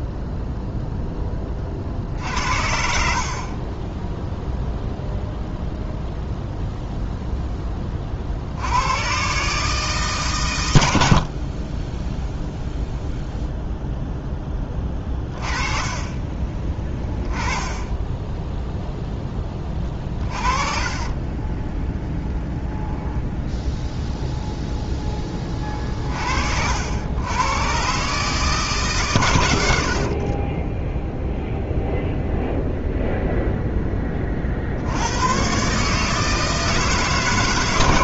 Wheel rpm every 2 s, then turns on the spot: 0, 50, 0, 0, 80, 90, 0, 20, 20, 0, 20, 0, 0, 90, 140, 10, 0, 80, 160.
2-4 20-22